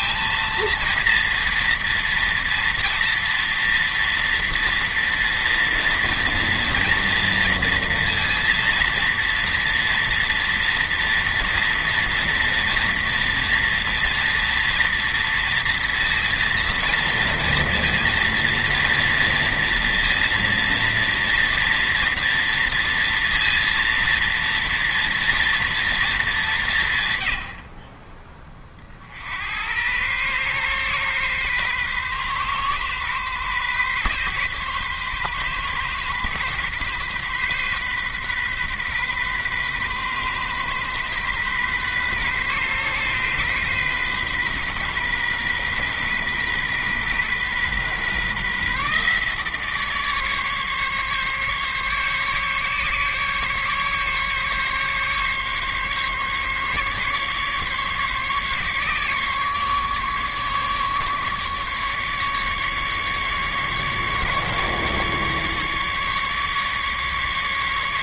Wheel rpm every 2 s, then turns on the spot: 230, 230, 230, 230, 230, 230, 240, 230, 230, 230, 230, 230, 230, 170, 50, 130, 130, 130, 130, 130, 130, 130, 130, 130, 140, 140, 140, 140, 150, 140, 150, 150, 150, 150.
none